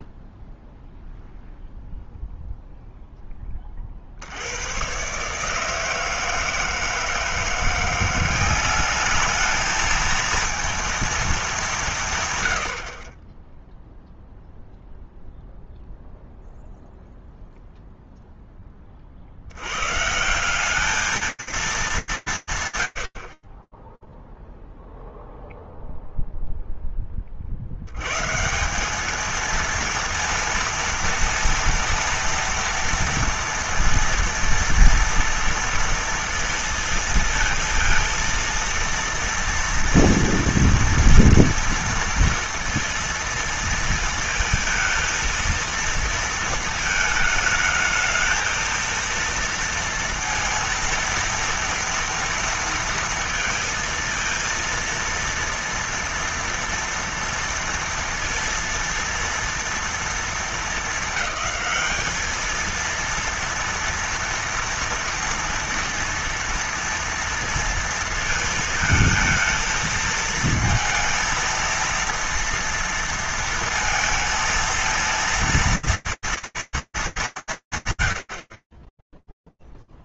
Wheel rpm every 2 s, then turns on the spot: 0, 0, 90, 160, 190, 230, 120, 0, 0, 10, 180, 180, 0, 0, 160, 230, 230, 230, 230, 230, 230, 230, 220, 220, 230, 230, 230, 230, 230, 230, 220, 230, 230, 230, 230, 220, 230, 230, 230, 60.
none